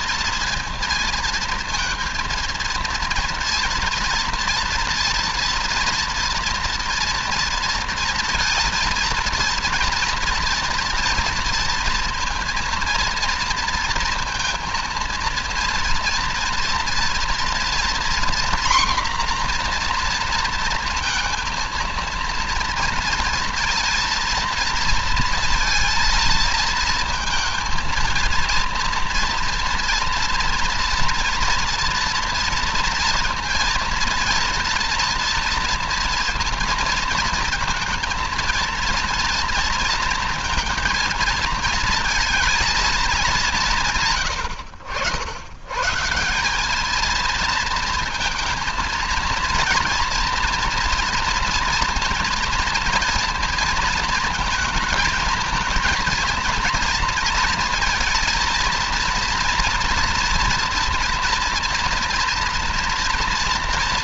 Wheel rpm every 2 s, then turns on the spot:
230, 230, 230, 230, 230, 240, 230, 230, 230, 240, 230, 230, 230, 230, 230, 230, 230, 230, 230, 230, 230, 220, 80, 210, 230, 230, 230, 220, 230, 230, 230, 230.
none